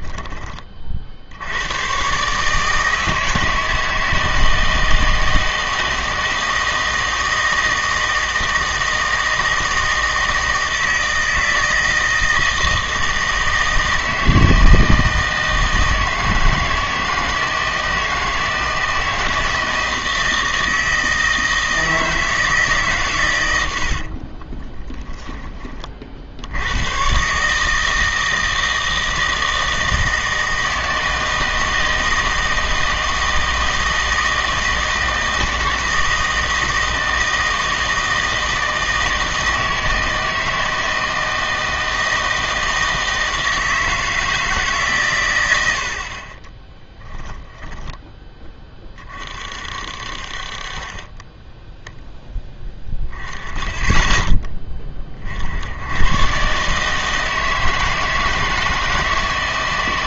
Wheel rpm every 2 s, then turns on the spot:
30, 160, 160, 160, 160, 160, 160, 160, 160, 160, 160, 150, 20, 100, 160, 160, 160, 160, 160, 160, 160, 160, 150, 10, 20, 30, 10, 20, 140, 160.
24-26 46-48